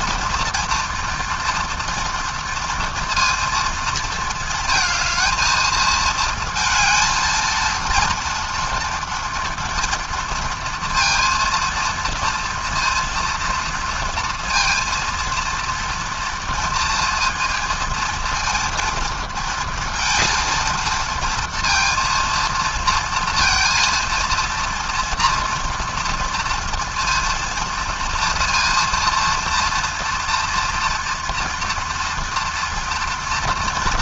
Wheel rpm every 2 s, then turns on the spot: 230, 230, 220, 230, 230, 230, 230, 230, 230, 230, 230, 230, 230, 230, 230, 230, 230.
none